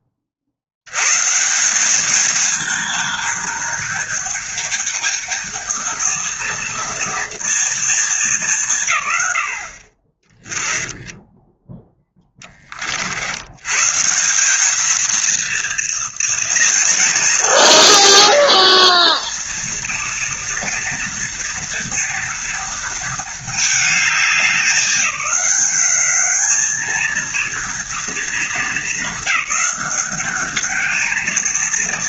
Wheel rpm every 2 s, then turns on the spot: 90, 220, 220, 230, 160, 10, 40, 220, 230, 220, 230, 220, 190, 210, 210, 220.
none